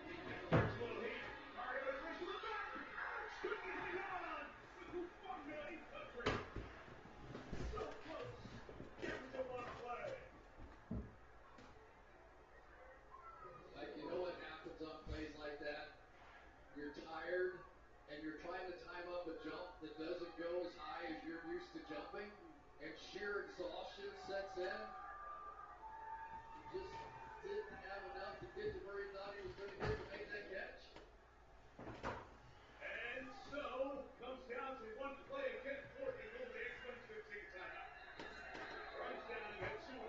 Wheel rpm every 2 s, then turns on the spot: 0, 0, 0, 0, 0, 0, 0, 0, 0, 0, 0, 0, 0, 0, 0, 0, 0, 0, 0, 0.
none